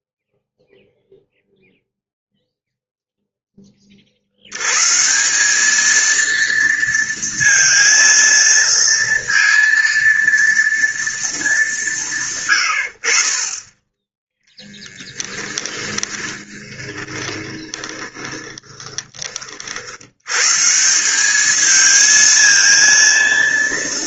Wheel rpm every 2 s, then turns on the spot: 0, 0, 140, 230, 230, 230, 70, 10, 20, 20, 160, 230.
14-20